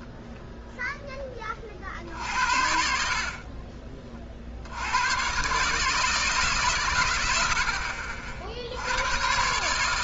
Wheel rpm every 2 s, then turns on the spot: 0, 60, 60, 150, 60.
none